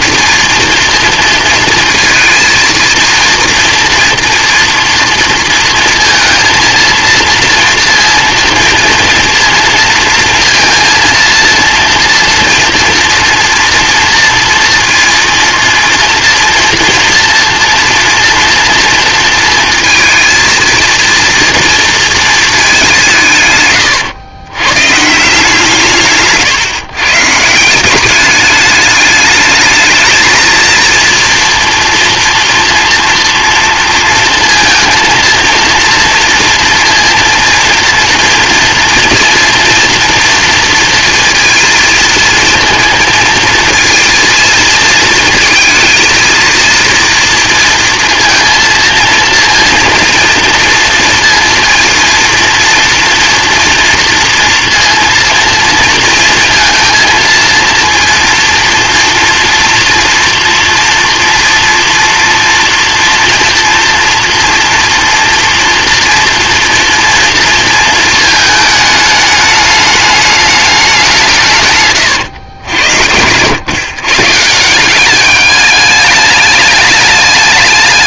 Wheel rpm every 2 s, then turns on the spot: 230, 230, 230, 230, 230, 230, 230, 230, 230, 230, 230, 200, 130, 140, 210, 230, 240, 230, 240, 230, 230, 230, 230, 230, 230, 230, 230, 230, 230, 230, 230, 230, 230, 230, 220, 200, 90, 180, 210.
72-74